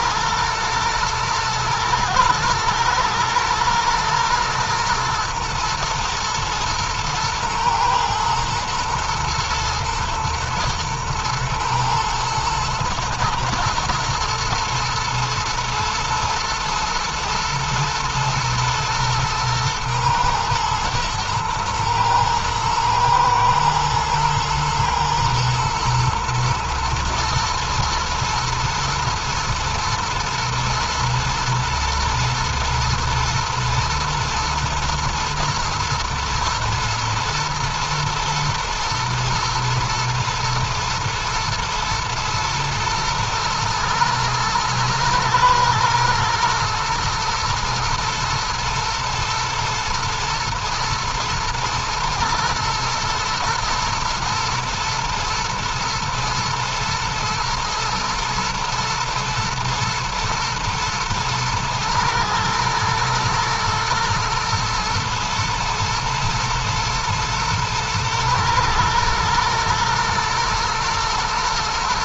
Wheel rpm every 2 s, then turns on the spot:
110, 110, 110, 110, 120, 110, 110, 120, 120, 110, 120, 110, 110, 110, 110, 120, 110, 120, 120, 110, 110, 110, 110, 120, 120, 120, 120, 120, 120, 110, 110, 110, 120, 110, 110, 120.
none